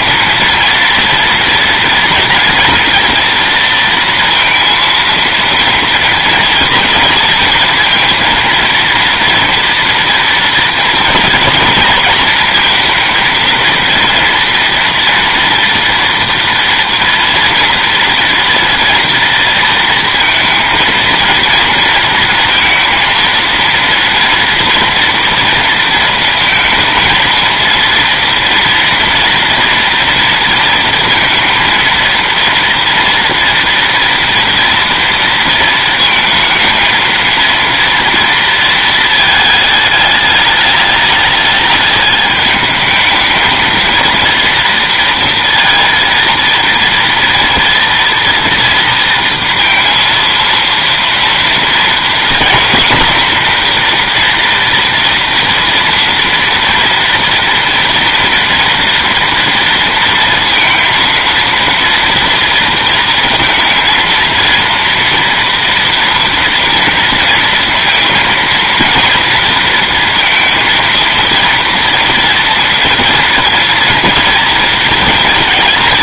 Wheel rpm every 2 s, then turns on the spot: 230, 230, 240, 230, 230, 230, 230, 230, 230, 230, 230, 230, 230, 230, 230, 230, 230, 220, 230, 210, 210, 230, 230, 230, 230, 250, 240, 230, 230, 230, 230, 230, 230, 230, 230, 230, 230, 230.
none